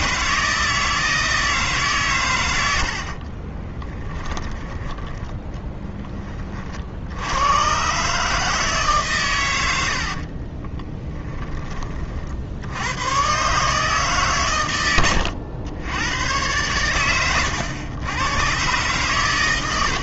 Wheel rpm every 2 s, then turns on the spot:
160, 80, 10, 50, 150, 30, 80, 110, 110, 120.
10-12